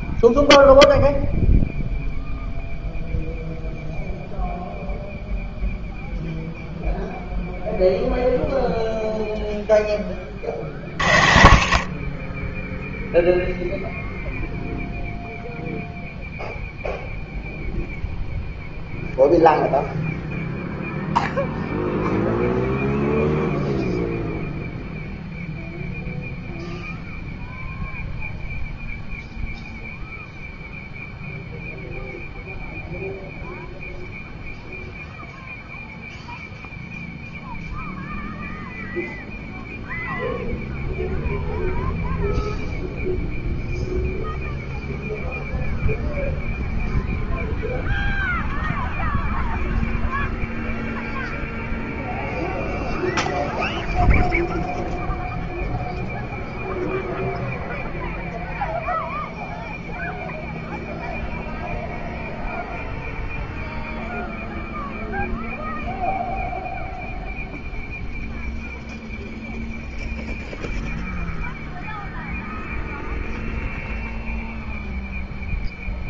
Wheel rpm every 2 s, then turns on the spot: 0, 0, 0, 0, 0, 60, 0, 0, 0, 0, 0, 0, 0, 0, 0, 0, 0, 0, 0, 0, 0, 0, 0, 0, 0, 0, 0, 0, 0, 0, 0, 0, 0, 0, 0, 0, 0, 0.
none